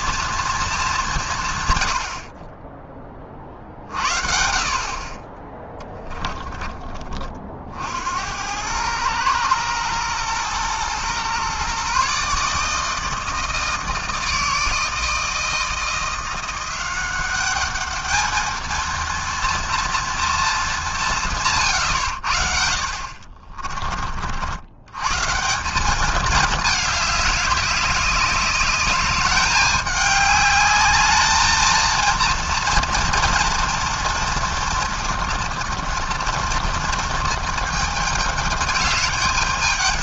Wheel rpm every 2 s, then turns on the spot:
230, 30, 50, 20, 100, 120, 150, 160, 180, 220, 210, 50, 90, 210, 200, 200, 230, 230, 230, 220.
6-8